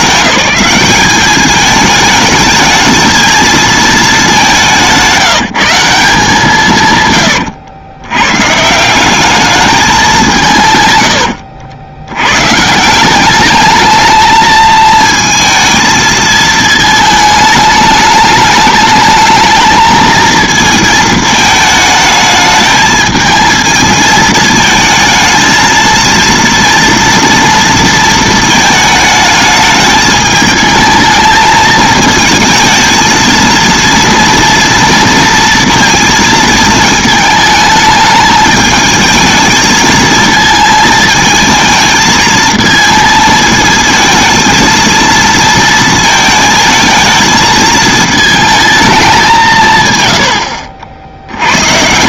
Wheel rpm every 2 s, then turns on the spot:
200, 220, 190, 160, 150, 130, 140, 220, 220, 210, 220, 220, 220, 230, 220, 220, 220, 230, 220, 220, 220, 220, 230, 220, 220, 100.
none